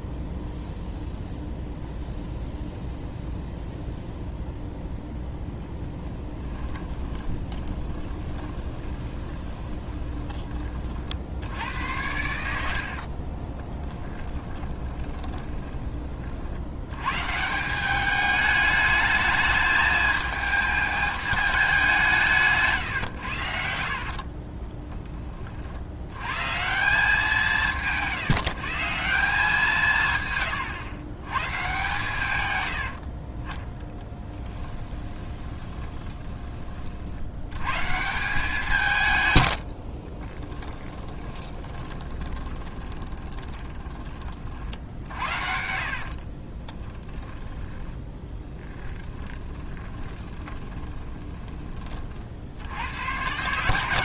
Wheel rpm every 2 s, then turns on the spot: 0, 0, 0, 20, 20, 40, 50, 20, 90, 210, 220, 130, 10, 160, 160, 110, 90, 20, 50, 150, 20, 20, 50, 10, 10, 10, 90.
6-10 12-16 32-36 40-48 50-52